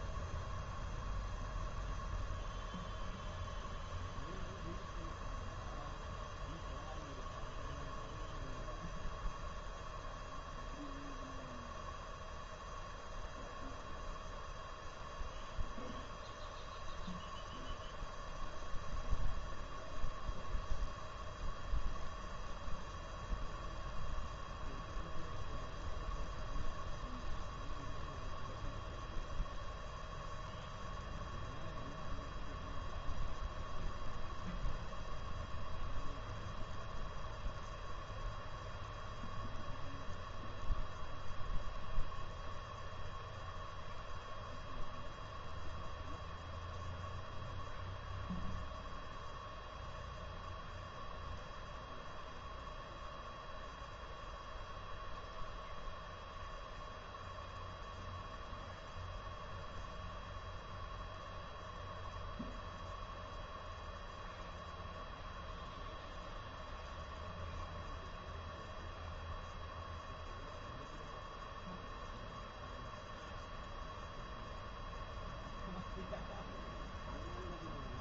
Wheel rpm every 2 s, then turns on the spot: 0, 0, 0, 0, 0, 0, 0, 0, 0, 0, 0, 0, 0, 0, 0, 0, 0, 0, 0, 0, 0, 0, 0, 0, 0, 0, 0, 0, 0, 0, 0, 0, 0, 0, 0, 0, 0, 0, 0.
none